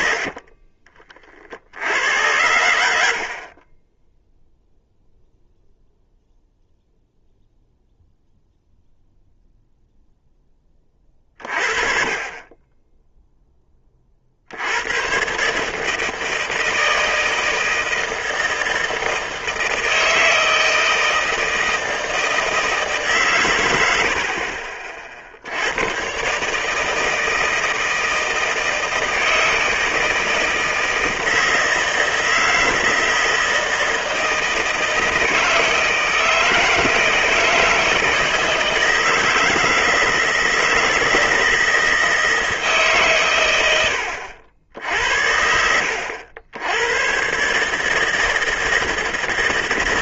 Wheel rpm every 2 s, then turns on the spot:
30, 90, 0, 0, 0, 20, 20, 90, 160, 160, 160, 160, 40, 150, 160, 160, 160, 160, 160, 160, 160, 150, 80, 90, 160.
0-2